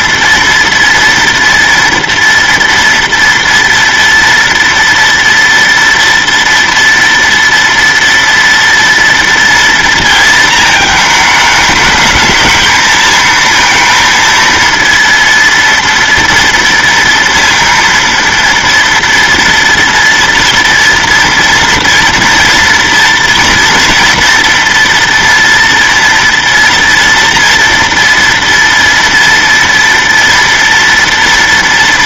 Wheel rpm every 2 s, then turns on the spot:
230, 230, 230, 230, 230, 220, 220, 230, 230, 230, 230, 230, 230, 230, 230, 230.
none